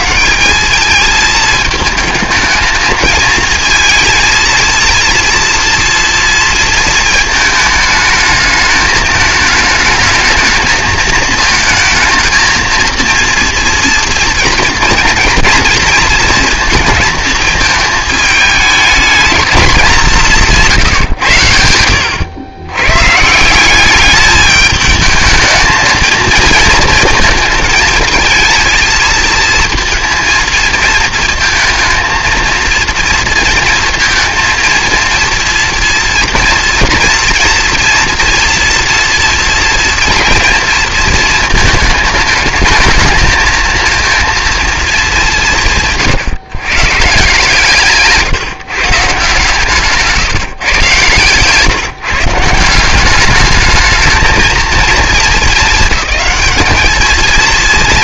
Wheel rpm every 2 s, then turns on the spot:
200, 220, 230, 230, 220, 220, 230, 230, 230, 210, 150, 110, 210, 230, 220, 230, 230, 230, 230, 230, 230, 220, 220, 140, 150, 130, 170, 220, 210.
none